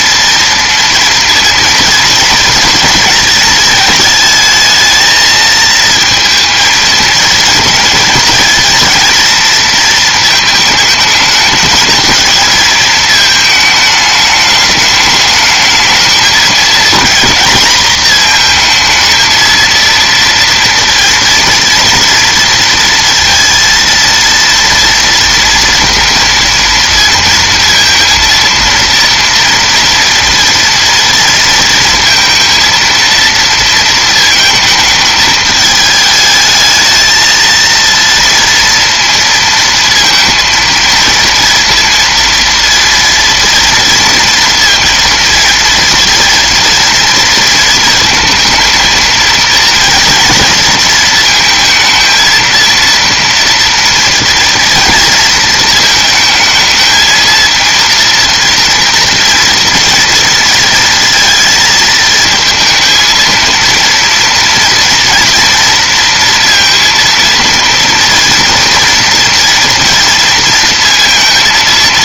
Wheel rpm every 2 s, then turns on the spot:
230, 230, 220, 220, 230, 220, 220, 210, 220, 230, 230, 230, 230, 230, 230, 230, 230, 220, 220, 230, 230, 230, 230, 230, 220, 230, 230, 230, 220, 230, 220, 220, 230, 230, 230, 230.
none